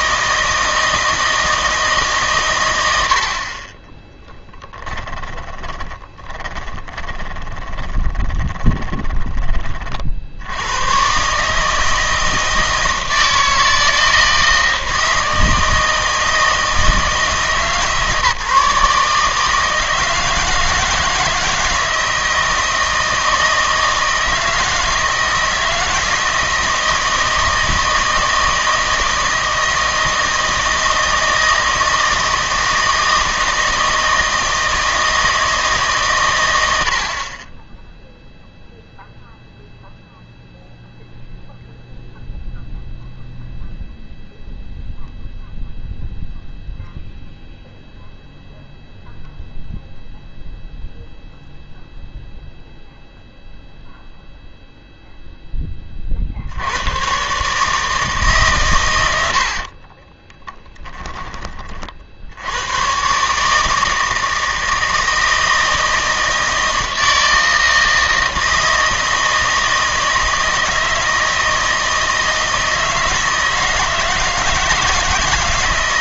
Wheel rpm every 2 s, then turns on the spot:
160, 80, 10, 20, 20, 100, 160, 160, 160, 150, 160, 160, 160, 160, 160, 160, 160, 160, 80, 0, 0, 0, 0, 0, 0, 0, 0, 0, 100, 120, 10, 120, 160, 160, 160, 160, 160, 160.
2-10